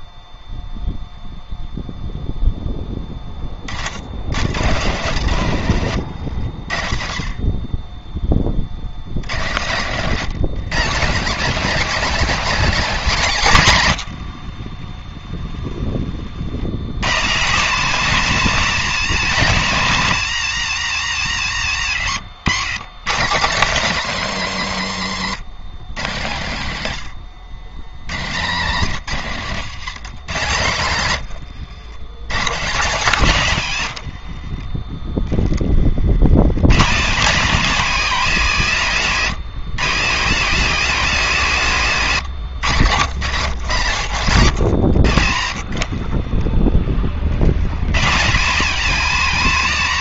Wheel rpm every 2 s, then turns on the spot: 40, 120, 20, 140, 220, 140, 20, 160, 160, 90, 210, 170, 90, 190, 50, 150, 40, 140, 150, 180, 130, 110, 30, 160, 100.
2-4 6-8 28-30 32-34